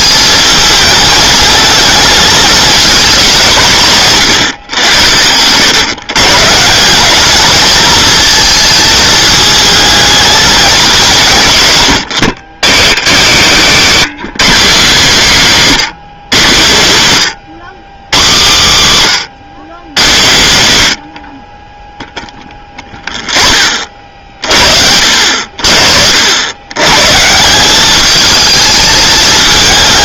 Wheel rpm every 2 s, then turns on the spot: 220, 220, 110, 160, 220, 200, 80, 210, 140, 160, 140, 10, 50, 100, 220.
none